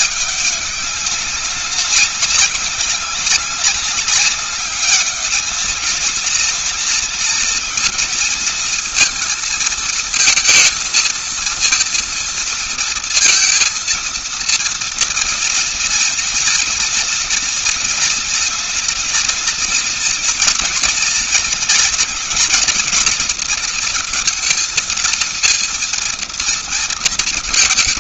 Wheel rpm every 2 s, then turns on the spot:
190, 190, 200, 230, 230, 220, 230, 230, 230, 230, 230, 230, 220, 230.
none